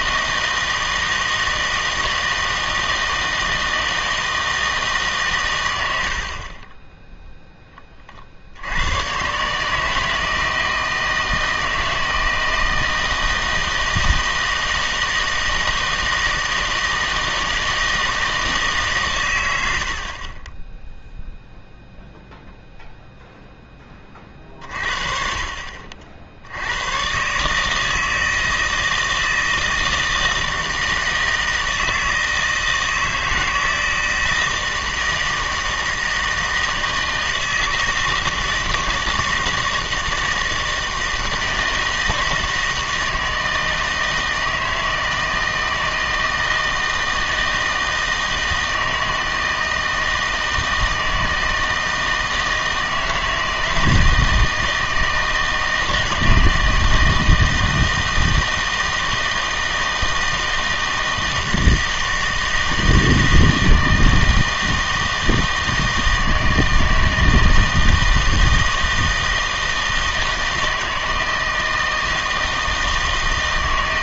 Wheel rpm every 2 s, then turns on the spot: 160, 160, 160, 30, 80, 160, 160, 160, 160, 150, 10, 0, 40, 80, 160, 160, 160, 160, 160, 160, 160, 160, 160, 160, 160, 160, 160, 160, 160, 160, 160, 160, 160, 160, 160, 160, 160.
none